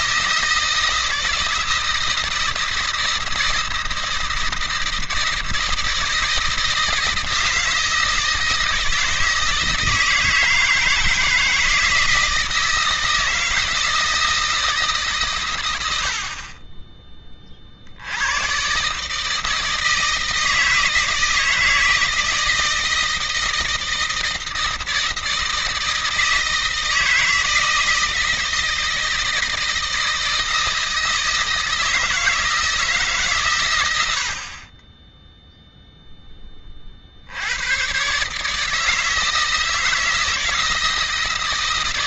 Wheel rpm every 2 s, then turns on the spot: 160, 160, 160, 160, 160, 160, 160, 160, 30, 110, 160, 160, 160, 160, 160, 160, 160, 60, 20, 150, 160.
none